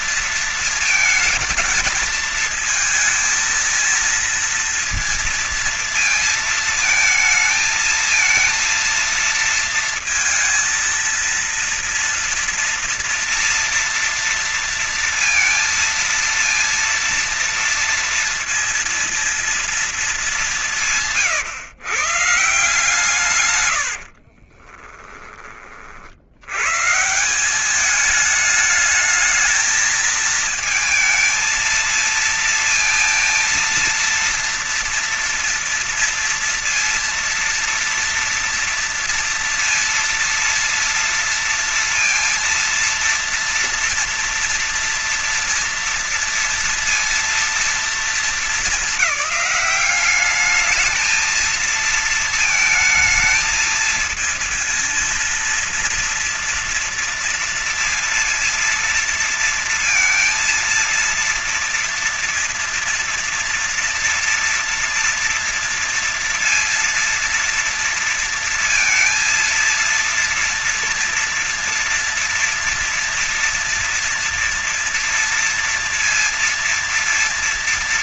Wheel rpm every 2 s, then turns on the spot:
220, 220, 230, 220, 220, 230, 230, 230, 230, 230, 160, 140, 20, 130, 220, 220, 230, 230, 230, 230, 230, 230, 230, 230, 210, 220, 220, 230, 230, 230, 230, 230, 230, 230, 230, 230, 230, 230, 230.
22-26